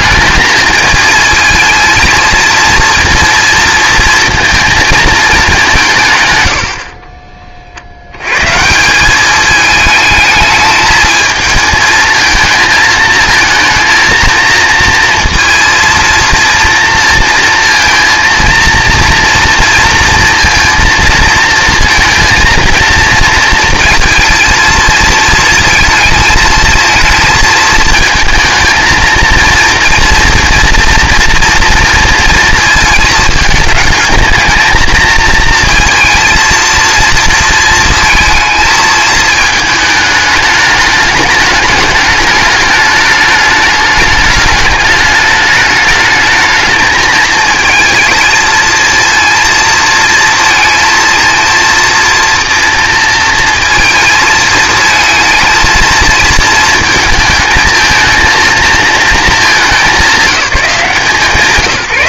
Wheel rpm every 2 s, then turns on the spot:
220, 230, 230, 50, 170, 220, 230, 230, 230, 230, 230, 230, 230, 230, 230, 230, 220, 220, 230, 220, 210, 210, 210, 220, 230, 230, 230, 220, 220, 220, 180.
none